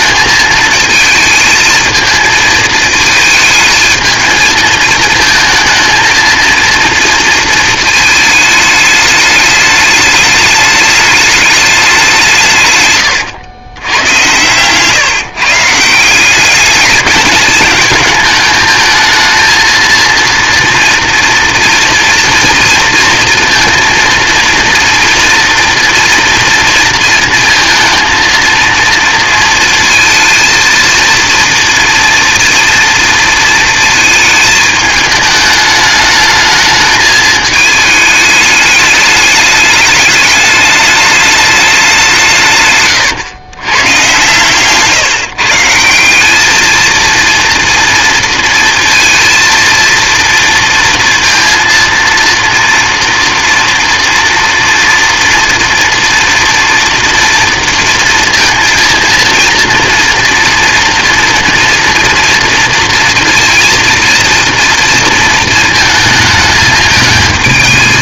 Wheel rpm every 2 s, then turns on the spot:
220, 220, 220, 230, 220, 210, 120, 140, 200, 220, 230, 230, 230, 230, 230, 230, 230, 220, 220, 210, 210, 150, 140, 220, 230, 230, 230, 240, 230, 230, 230, 230, 230, 220.
none